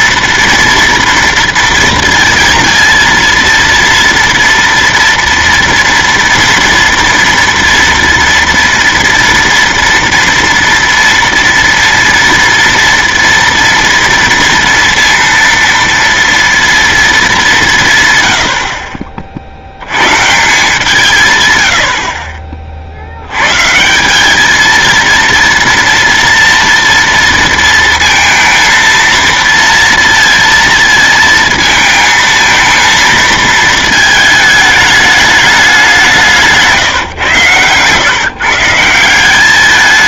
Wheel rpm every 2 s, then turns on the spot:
230, 230, 240, 230, 230, 230, 230, 230, 230, 70, 160, 40, 220, 230, 230, 230, 220, 220, 160, 140.
none